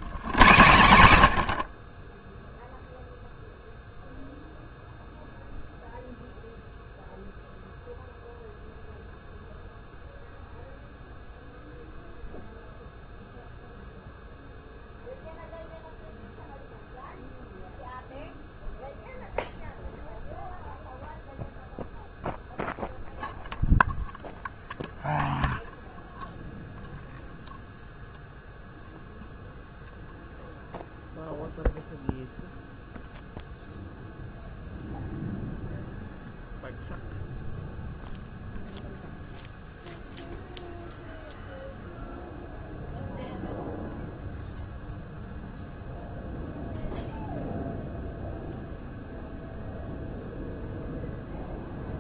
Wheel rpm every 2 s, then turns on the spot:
110, 0, 0, 0, 0, 0, 0, 0, 0, 0, 0, 0, 0, 0, 0, 0, 0, 0, 0, 0, 0, 0, 0, 0, 0, 0.
none